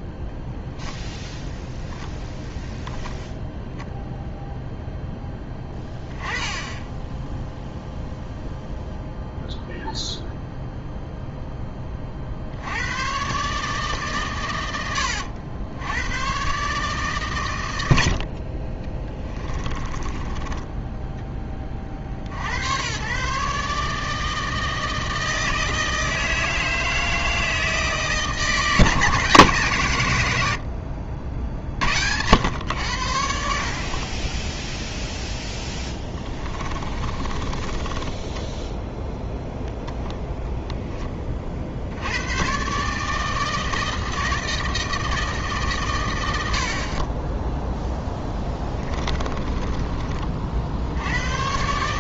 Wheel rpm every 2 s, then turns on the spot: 10, 0, 0, 10, 0, 0, 90, 100, 140, 30, 10, 110, 160, 160, 160, 80, 90, 0, 30, 0, 0, 140, 160, 70, 30, 70.
0-2 36-38 48-50